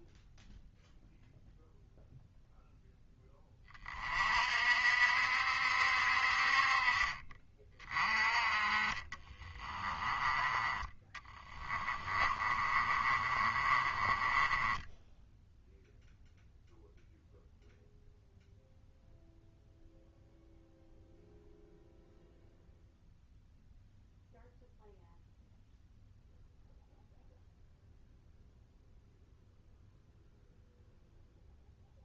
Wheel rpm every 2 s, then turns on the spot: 0, 0, 60, 40, 20, 20, 30, 10, 0, 0, 0, 0, 0, 0, 0, 0.
8-10 12-16